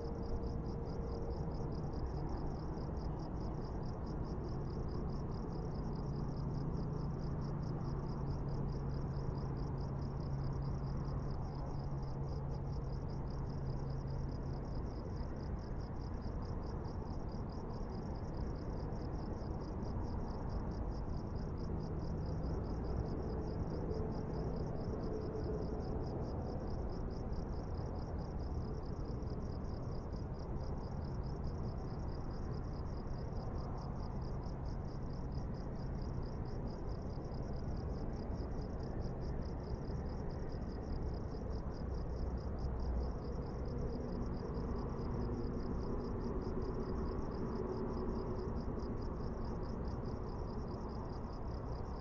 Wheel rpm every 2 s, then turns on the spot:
0, 0, 0, 0, 0, 0, 0, 0, 0, 0, 0, 0, 0, 0, 0, 0, 0, 0, 0, 0, 0, 0, 0, 0, 0, 0.
none